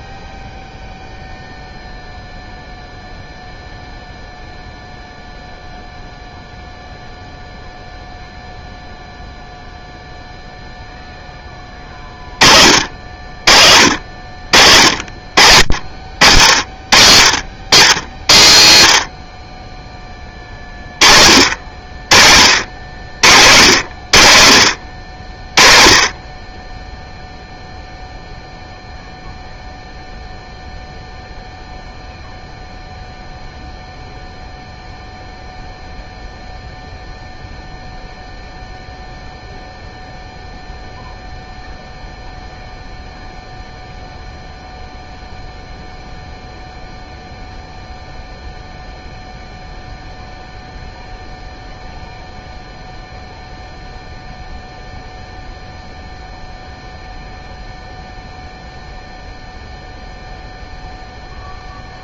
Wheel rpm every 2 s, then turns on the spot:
0, 0, 0, 0, 0, 0, 50, 60, 60, 70, 40, 70, 70, 10, 0, 0, 0, 0, 0, 0, 0, 0, 0, 0, 0, 0, 0, 0, 0, 0, 0.
none